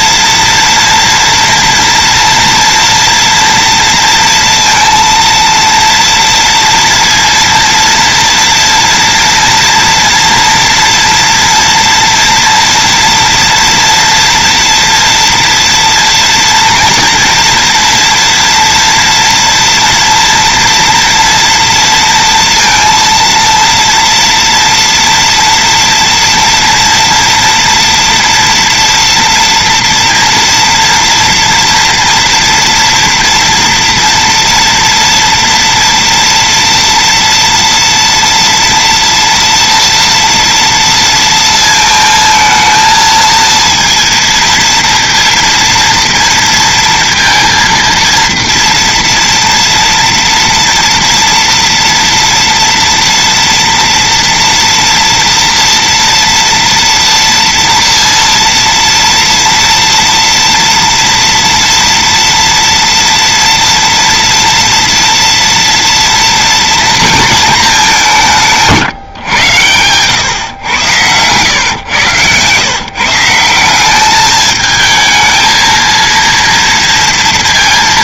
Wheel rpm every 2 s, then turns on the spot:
230, 230, 230, 230, 230, 230, 230, 230, 230, 240, 230, 230, 230, 240, 240, 230, 230, 230, 230, 230, 230, 220, 230, 230, 230, 230, 230, 230, 230, 230, 230, 230, 230, 230, 150, 110, 150, 220, 230.
none